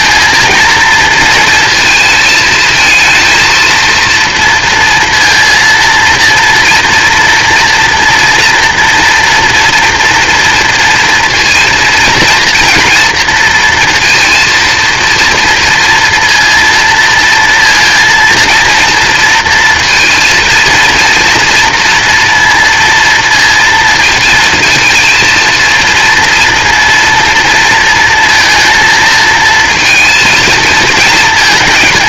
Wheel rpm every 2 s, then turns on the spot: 230, 220, 230, 240, 230, 230, 230, 230, 230, 230, 230, 230, 230, 230, 230, 220.
none